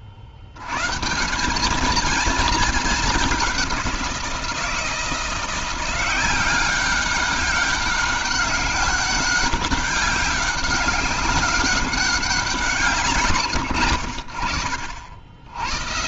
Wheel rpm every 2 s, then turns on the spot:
120, 210, 170, 190, 200, 200, 170, 70.
none